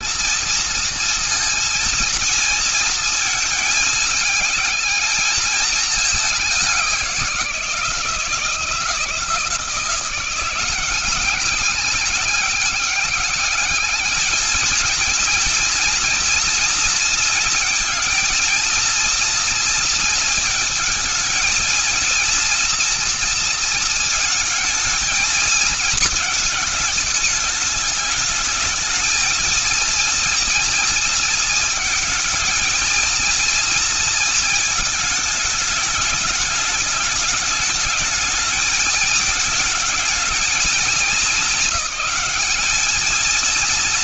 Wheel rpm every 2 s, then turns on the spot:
230, 220, 220, 180, 170, 190, 200, 230, 230, 230, 220, 230, 220, 220, 220, 220, 230, 220, 210, 220, 220, 220.
none